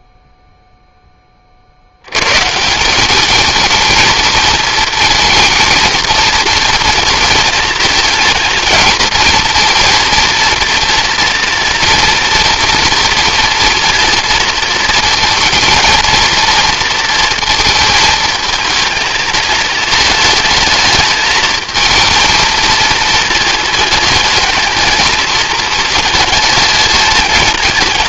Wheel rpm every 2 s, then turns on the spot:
0, 170, 220, 230, 220, 230, 230, 230, 230, 230, 220, 220, 230, 220.
none